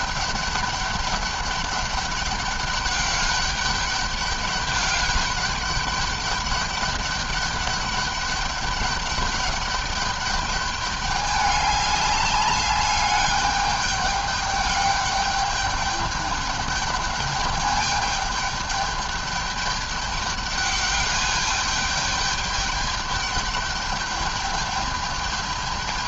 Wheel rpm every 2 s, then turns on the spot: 200, 200, 200, 200, 200, 200, 200, 200, 210, 210, 210, 210, 210.
none